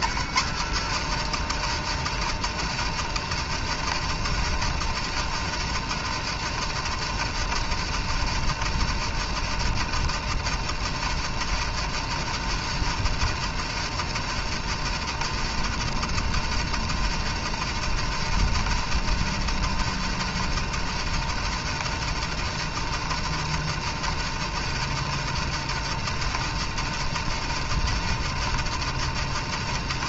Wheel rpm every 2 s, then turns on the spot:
150, 160, 160, 160, 160, 160, 160, 160, 160, 160, 160, 160, 160, 160, 160.
none